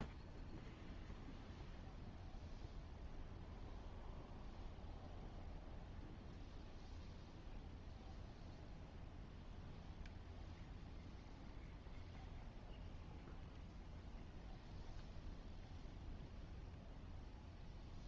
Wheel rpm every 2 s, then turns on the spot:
0, 0, 0, 0, 0, 0, 0, 0, 0.
none